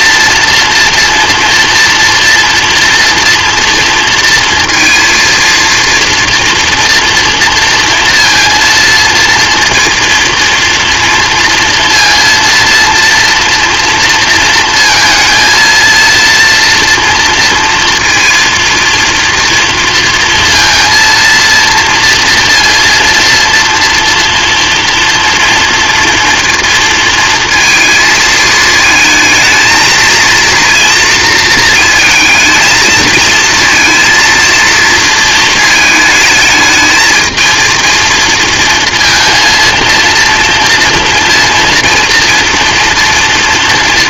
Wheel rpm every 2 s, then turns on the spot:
230, 230, 230, 230, 230, 230, 230, 230, 230, 230, 230, 230, 230, 230, 220, 230, 220, 230, 220, 230, 230, 230.
none